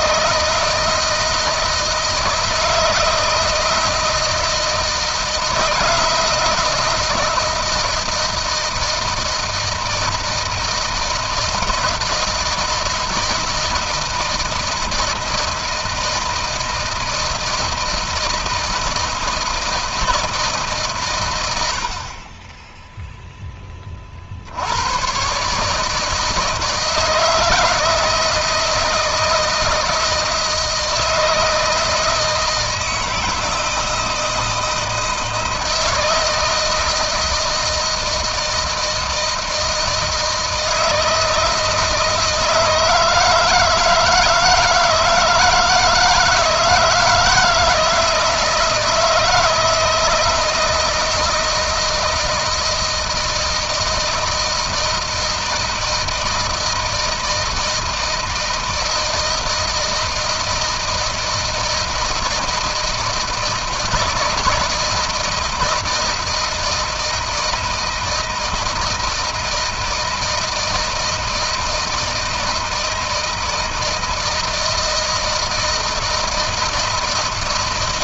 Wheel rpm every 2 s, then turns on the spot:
160, 160, 160, 160, 160, 160, 160, 160, 160, 160, 160, 30, 50, 160, 160, 160, 160, 160, 160, 160, 160, 160, 160, 160, 160, 160, 160, 160, 160, 160, 160, 160, 160, 160, 160, 160, 160, 160, 160.
none